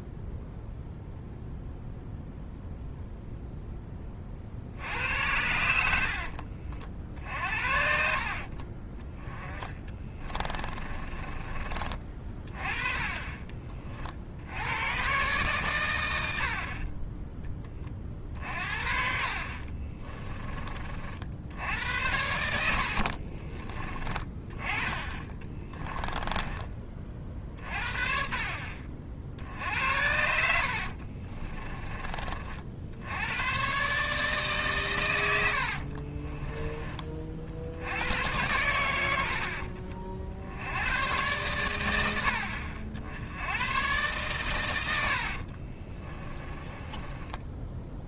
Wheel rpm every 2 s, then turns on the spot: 0, 0, 60, 60, 30, 20, 30, 90, 40, 50, 30, 70, 20, 20, 50, 60, 60, 130, 30, 100, 110, 50, 100, 20.
8-12 22-24 30-32 44-48